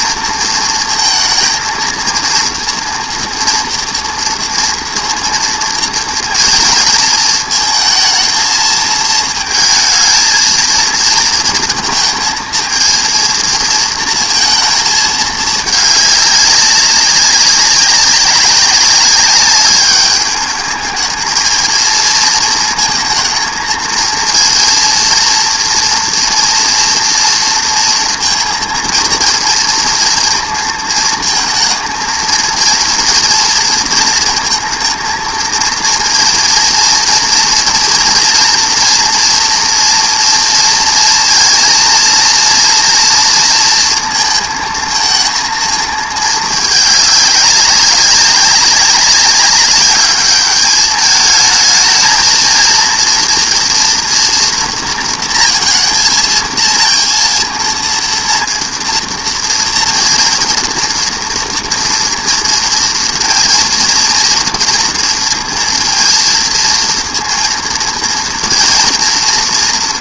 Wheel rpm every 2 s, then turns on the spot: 220, 230, 230, 230, 220, 220, 220, 220, 200, 190, 210, 230, 230, 230, 230, 230, 230, 230, 230, 240, 230, 230, 230, 220, 200, 210, 230, 230, 230, 230, 230, 230, 230, 230, 240.
none